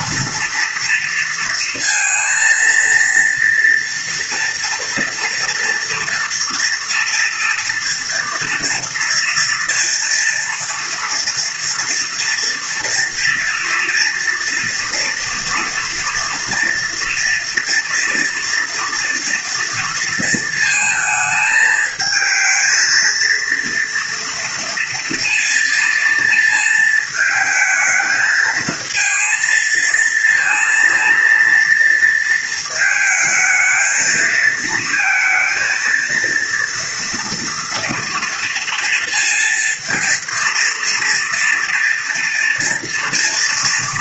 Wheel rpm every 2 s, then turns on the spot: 230, 230, 230, 230, 230, 230, 230, 230, 230, 230, 220, 220, 230, 230, 220, 230, 220, 230, 230, 230, 230, 230.
none